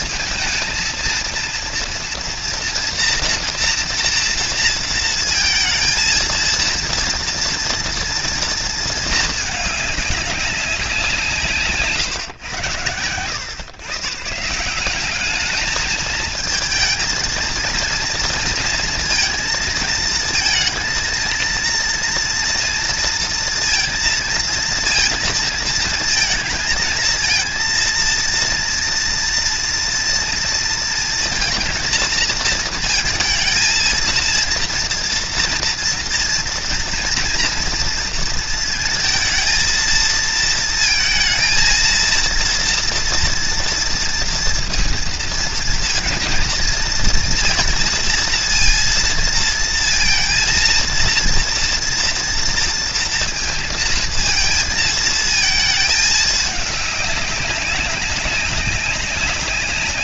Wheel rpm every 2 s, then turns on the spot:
230, 230, 230, 230, 220, 180, 100, 190, 220, 230, 230, 230, 230, 230, 230, 230, 220, 230, 240, 220, 230, 240, 230, 230, 230, 230, 230, 230, 200, 200.
none